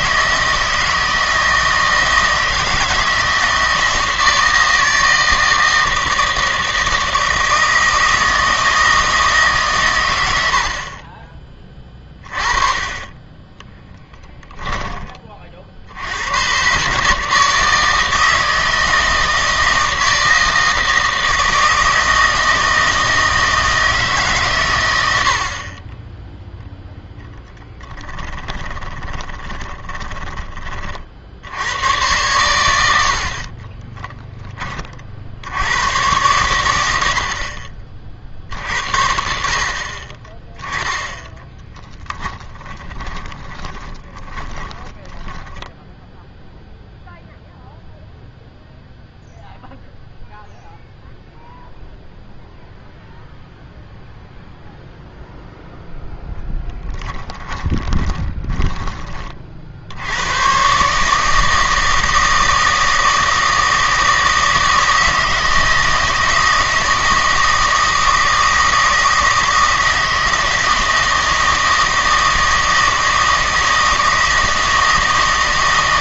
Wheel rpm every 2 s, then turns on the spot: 160, 160, 160, 160, 160, 70, 30, 10, 130, 160, 160, 160, 130, 10, 20, 30, 90, 30, 90, 60, 10, 20, 10, 0, 0, 0, 0, 0, 10, 20, 130, 160, 160, 160, 160, 160, 160, 160.
28-30 42-46 56-60